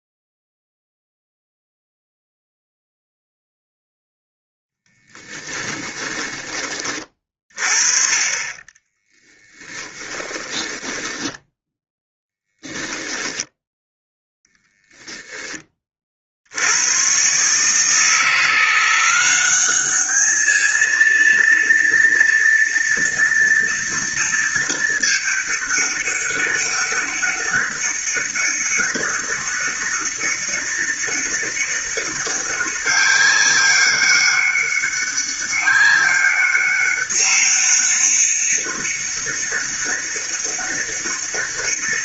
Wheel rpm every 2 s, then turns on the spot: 0, 0, 10, 30, 20, 10, 0, 0, 110, 180, 230, 230, 220, 200, 200, 200, 200, 200, 200, 200, 200.
4-6 8-12